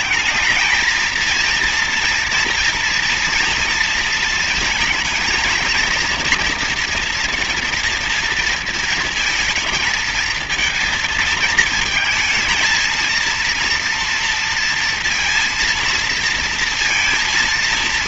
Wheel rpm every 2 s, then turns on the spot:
210, 230, 220, 230, 230, 220, 220, 230, 230.
none